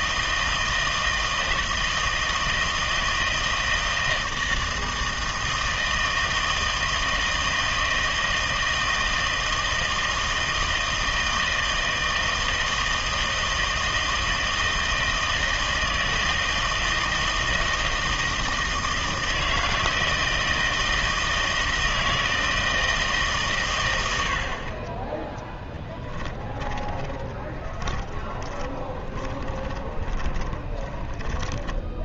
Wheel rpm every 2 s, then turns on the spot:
160, 160, 160, 160, 160, 160, 160, 160, 160, 160, 160, 160, 30, 20, 20, 20.
26-32